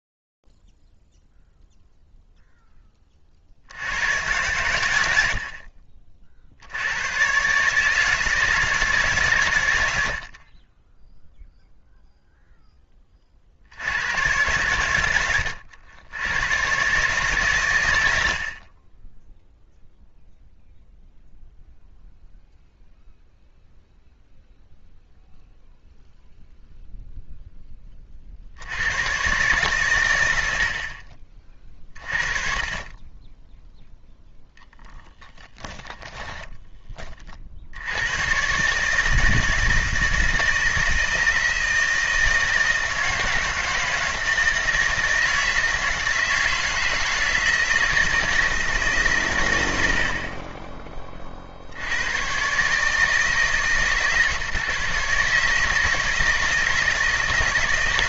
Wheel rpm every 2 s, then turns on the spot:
0, 0, 100, 50, 160, 80, 0, 90, 100, 50, 0, 0, 0, 0, 90, 80, 40, 10, 20, 140, 160, 160, 160, 160, 150, 30, 140, 150, 160.
34-36